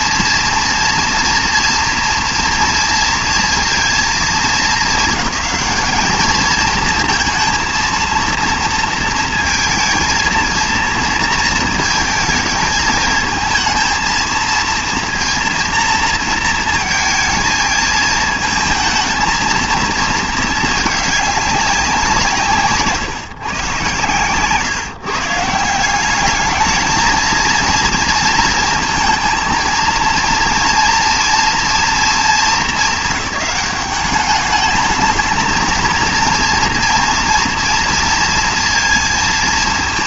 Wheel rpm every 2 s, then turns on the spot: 230, 230, 220, 220, 230, 230, 220, 230, 230, 220, 220, 150, 140, 220, 230, 230, 210, 210, 230, 230.
none